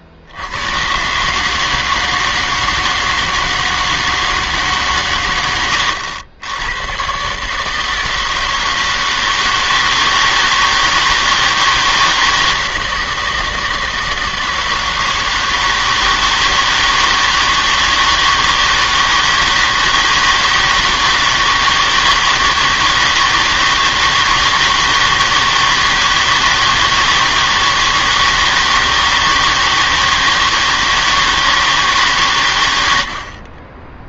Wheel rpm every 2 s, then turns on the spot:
100, 160, 150, 100, 160, 160, 160, 160, 160, 160, 160, 160, 160, 160, 160, 160, 100.
none